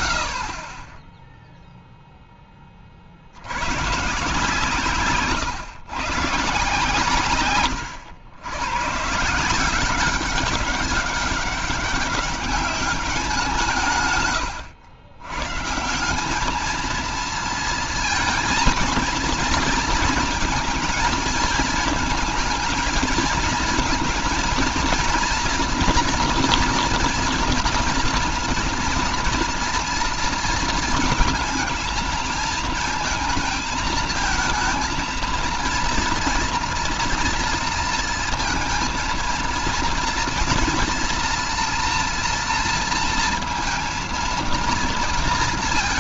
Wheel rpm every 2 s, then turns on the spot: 30, 40, 140, 140, 130, 190, 190, 120, 220, 220, 220, 220, 240, 240, 240, 220, 220, 230, 230, 230, 230, 230, 230.
none